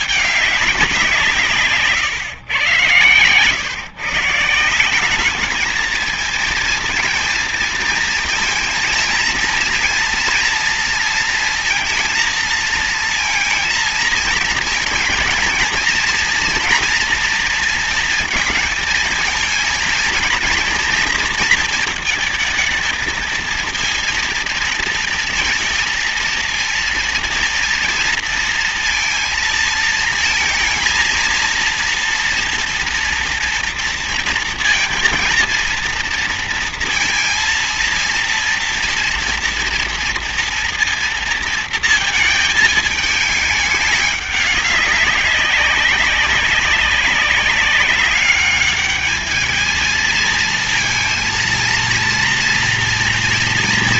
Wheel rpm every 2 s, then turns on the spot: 180, 110, 170, 230, 230, 230, 230, 230, 240, 220, 230, 220, 230, 230, 230, 230, 230, 230, 230, 230, 230, 220, 200, 190, 210, 230, 240.
none